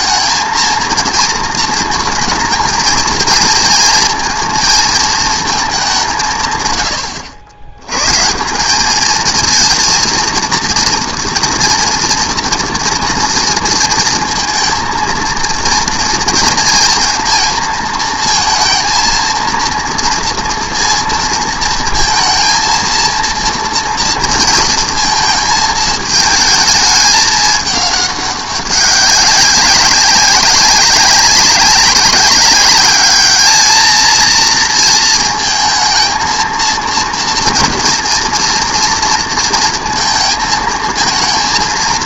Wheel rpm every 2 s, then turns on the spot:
230, 220, 230, 120, 190, 230, 230, 230, 230, 230, 230, 230, 230, 220, 200, 190, 200, 230, 230, 230, 230.
none